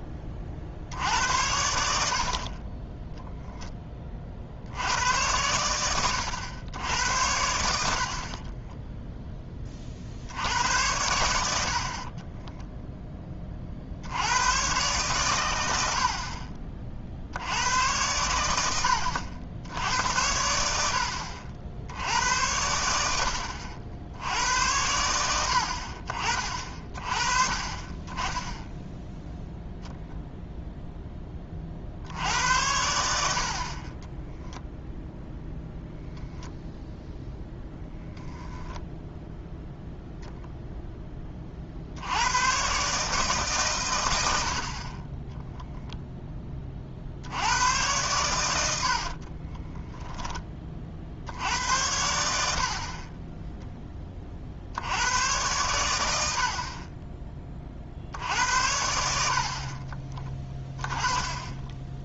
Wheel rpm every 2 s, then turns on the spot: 50, 20, 70, 90, 20, 90, 0, 110, 40, 80, 80, 90, 80, 40, 10, 0, 80, 0, 0, 10, 0, 120, 50, 30, 70, 30, 60, 70, 40, 80, 10.
8-10